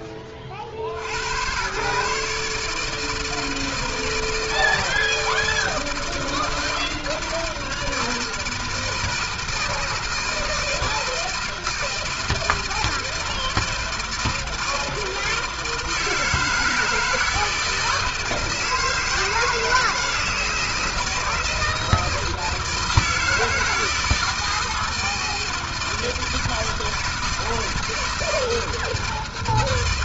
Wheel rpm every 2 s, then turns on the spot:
90, 160, 160, 160, 160, 160, 160, 160, 160, 160, 160, 160, 160, 160, 160.
none